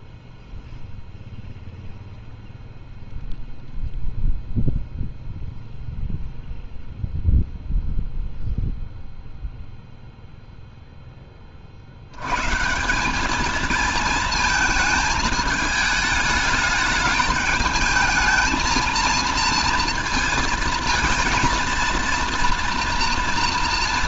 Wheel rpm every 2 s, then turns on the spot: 0, 0, 0, 0, 0, 0, 160, 220, 210, 220, 230, 230.
none